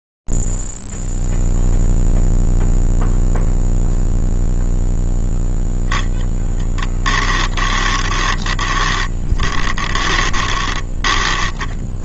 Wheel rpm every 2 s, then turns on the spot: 0, 0, 0, 10, 20, 20.
8-12